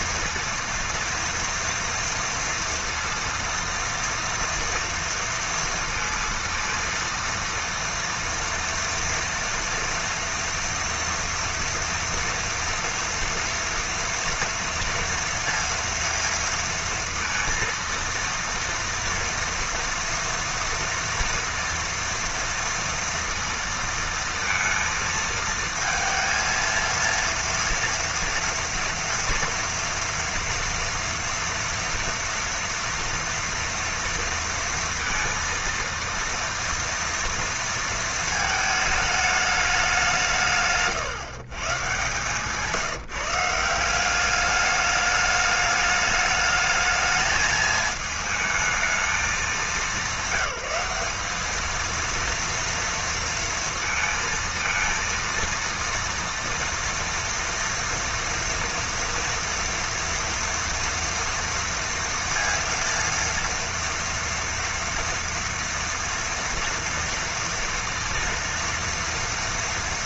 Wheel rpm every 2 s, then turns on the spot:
230, 230, 230, 230, 230, 230, 230, 230, 230, 230, 230, 230, 230, 230, 230, 230, 230, 230, 230, 220, 140, 150, 200, 210, 220, 200, 230, 230, 230, 230, 230, 230, 230, 230, 230.
none